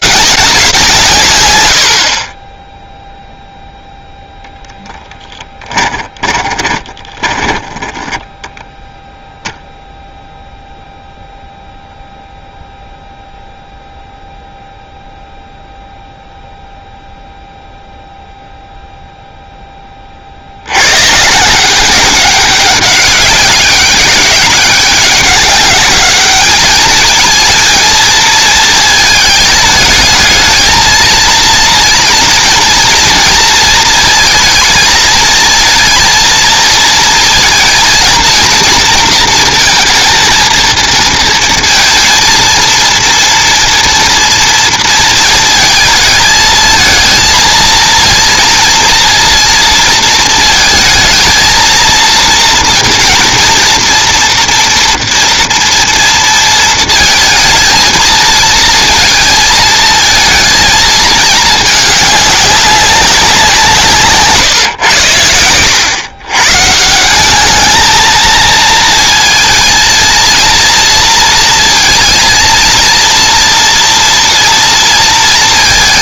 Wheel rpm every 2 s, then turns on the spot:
200, 30, 0, 20, 10, 0, 0, 0, 0, 0, 80, 200, 200, 210, 220, 220, 230, 230, 220, 230, 230, 230, 230, 220, 230, 220, 230, 230, 220, 230, 220, 200, 140, 150, 230, 230, 230, 230.
6-10